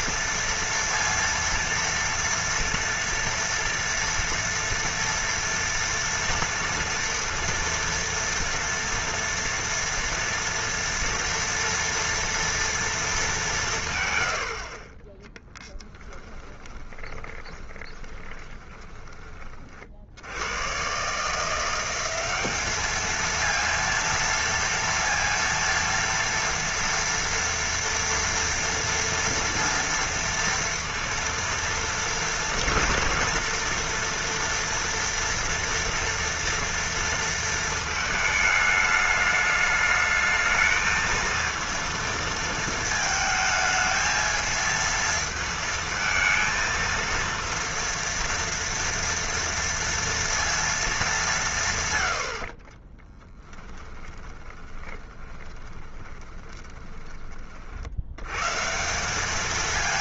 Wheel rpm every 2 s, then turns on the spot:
230, 230, 230, 230, 240, 230, 230, 20, 20, 20, 120, 210, 230, 230, 230, 230, 230, 230, 230, 210, 220, 220, 230, 230, 240, 220, 30, 20, 20, 170.
16-20 52-58